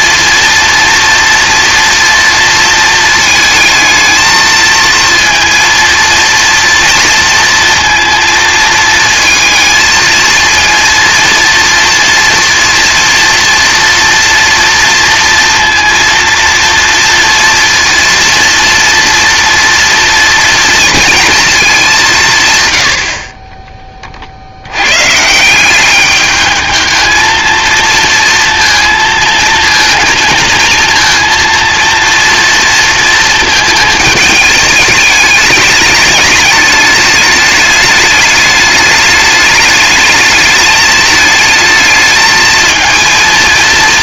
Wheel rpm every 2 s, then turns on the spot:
230, 230, 220, 230, 230, 230, 230, 230, 230, 230, 230, 90, 90, 210, 230, 230, 230, 210, 210, 210, 210, 220.
none